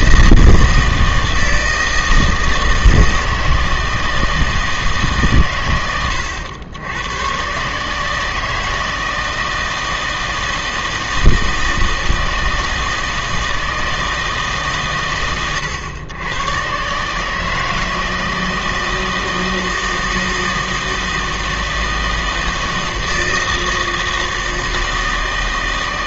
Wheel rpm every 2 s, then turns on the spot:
160, 160, 160, 90, 160, 160, 160, 130, 120, 160, 160, 160, 160.
none